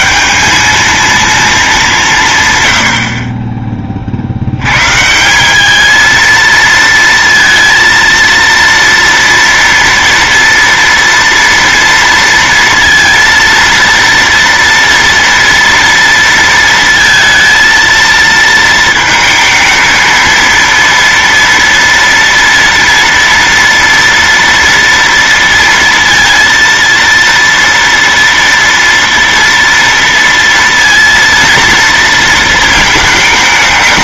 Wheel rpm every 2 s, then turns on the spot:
210, 130, 100, 230, 230, 230, 230, 230, 230, 230, 230, 230, 230, 230, 230, 230, 230.
none